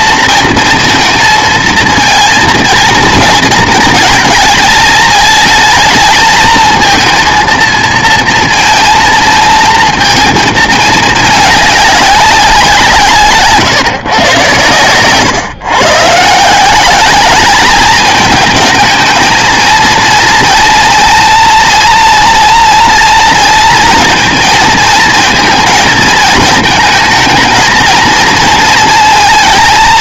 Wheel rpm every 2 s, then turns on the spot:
230, 230, 220, 230, 220, 220, 180, 120, 170, 220, 230, 230, 230, 220, 220.
none